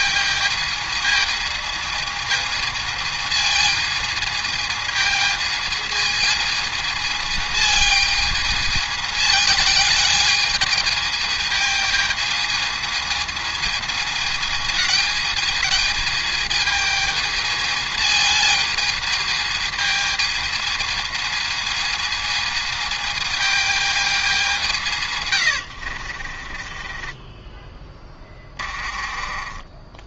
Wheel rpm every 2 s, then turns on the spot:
220, 220, 220, 220, 220, 220, 220, 200, 220, 220, 220, 220, 200, 50, 20.
26-30